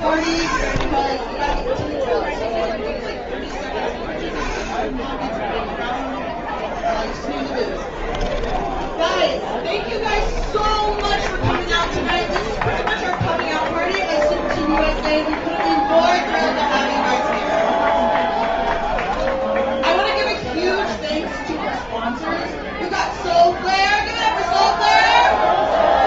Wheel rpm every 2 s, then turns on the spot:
20, 0, 20, 10, 10, 30, 20, 10, 0, 10, 0, 0, 0.
10-16 18-20